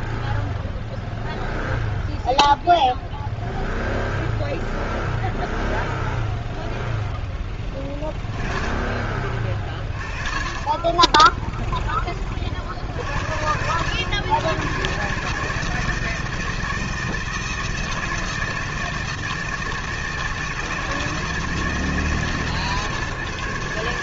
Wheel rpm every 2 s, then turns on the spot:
0, 0, 0, 0, 30, 10, 70, 150, 160, 160, 160, 140.
none